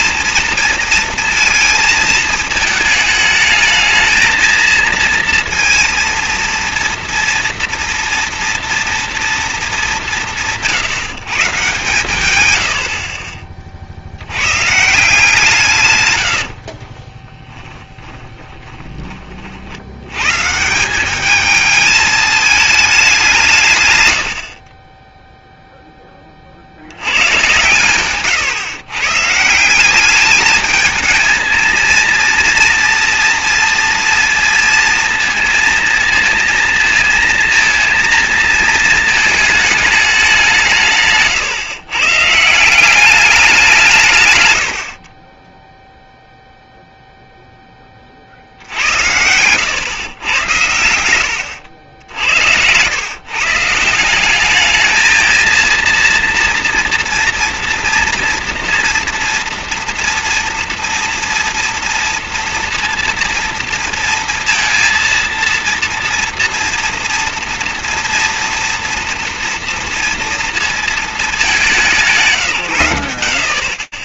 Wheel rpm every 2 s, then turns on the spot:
230, 220, 230, 230, 240, 160, 90, 140, 40, 20, 180, 220, 40, 80, 120, 210, 230, 230, 230, 230, 170, 180, 80, 0, 70, 90, 100, 210, 230, 240, 230, 230, 230, 230, 230, 220, 100.
16-20 48-50